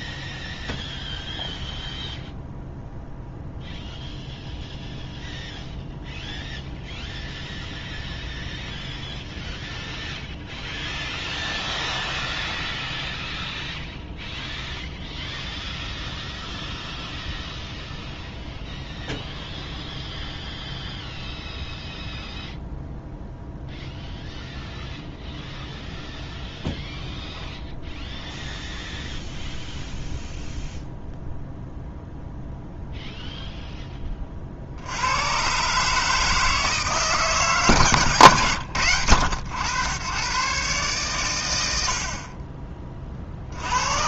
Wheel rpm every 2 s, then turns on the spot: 0, 0, 0, 0, 0, 0, 0, 0, 0, 0, 0, 0, 0, 0, 0, 0, 0, 60, 160, 110, 130, 30.
none